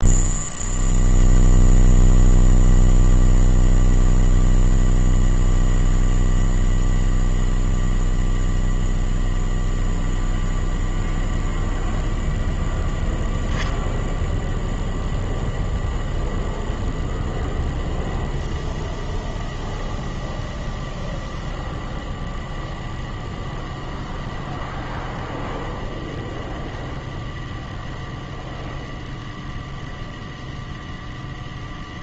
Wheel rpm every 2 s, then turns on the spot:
0, 0, 0, 0, 0, 0, 0, 0, 0, 0, 0, 0, 0, 0, 0, 0.
none